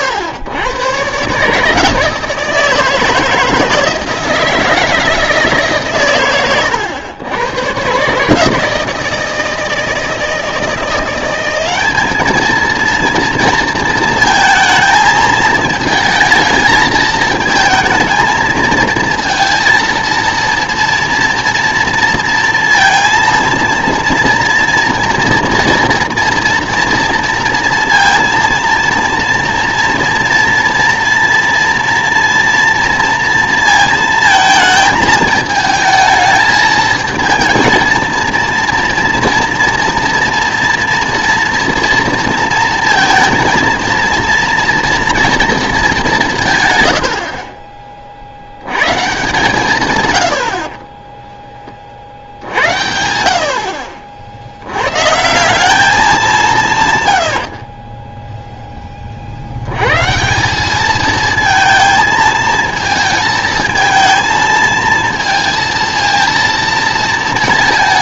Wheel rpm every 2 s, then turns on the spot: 120, 160, 160, 100, 160, 170, 230, 230, 220, 220, 230, 230, 230, 230, 230, 230, 230, 220, 220, 240, 230, 230, 230, 120, 110, 30, 80, 100, 150, 10, 200, 220, 230, 230.
none